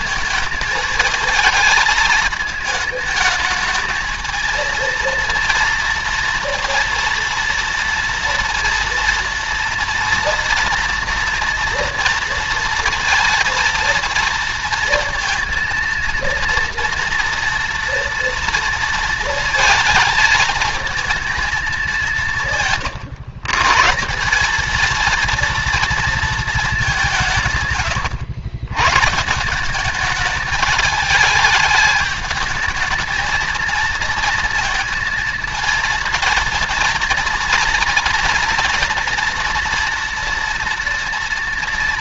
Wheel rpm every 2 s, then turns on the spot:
220, 220, 230, 230, 230, 230, 230, 230, 230, 230, 230, 140, 230, 170, 140, 210, 220, 230, 230, 230, 230.
none